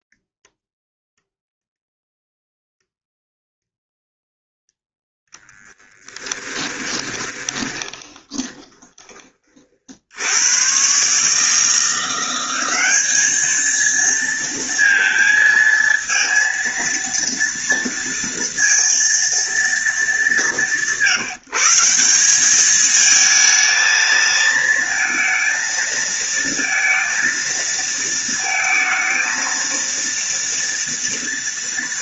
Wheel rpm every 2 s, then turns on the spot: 0, 0, 10, 20, 20, 110, 190, 230, 230, 230, 180, 210, 230, 230, 230, 230.
6-10